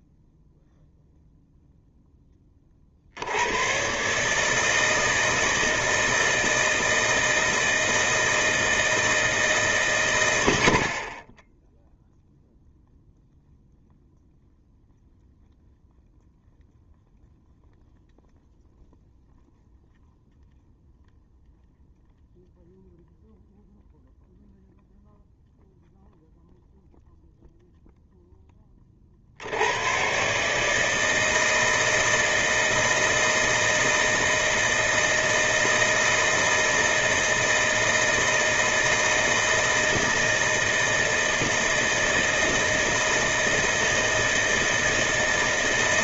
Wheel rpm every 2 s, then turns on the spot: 0, 20, 150, 160, 160, 90, 0, 0, 0, 0, 0, 0, 0, 0, 20, 150, 160, 160, 160, 160, 160, 160, 160.
none